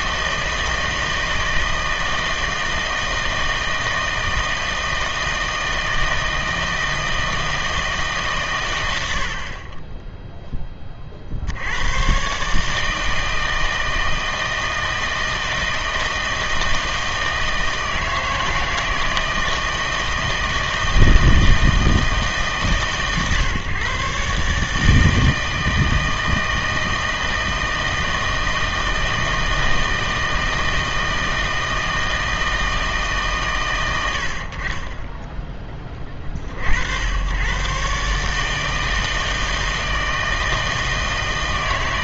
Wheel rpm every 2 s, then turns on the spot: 160, 160, 160, 160, 120, 20, 150, 160, 160, 160, 160, 150, 150, 160, 160, 160, 160, 40, 50, 160, 160.
none